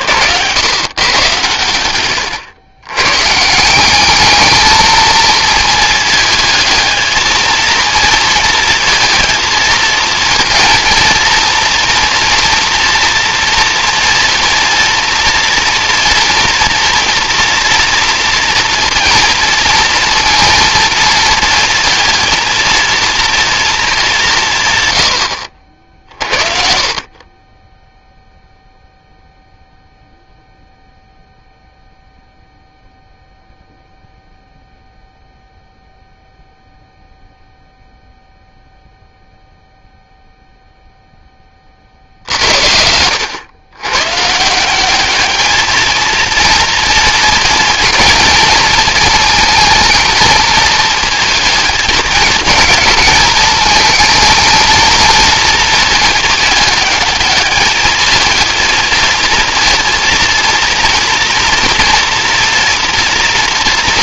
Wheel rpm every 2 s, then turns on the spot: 100, 100, 220, 220, 230, 230, 230, 230, 240, 230, 230, 230, 130, 50, 0, 0, 0, 0, 0, 0, 0, 70, 170, 230, 230, 230, 220, 220, 220, 220, 230, 230.
none